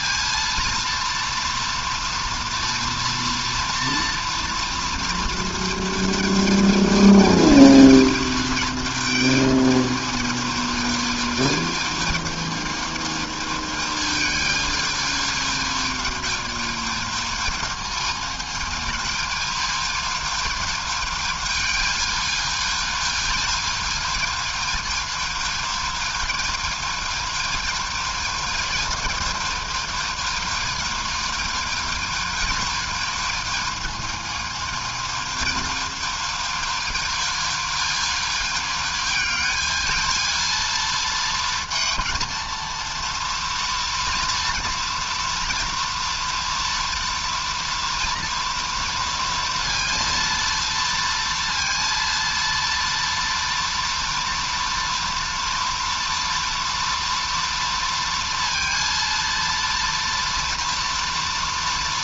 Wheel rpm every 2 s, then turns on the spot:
230, 230, 230, 220, 220, 220, 220, 220, 220, 220, 220, 210, 220, 220, 220, 220, 220, 220, 220, 220, 230, 230, 230, 230, 230, 230, 230, 230, 230, 230, 230.
none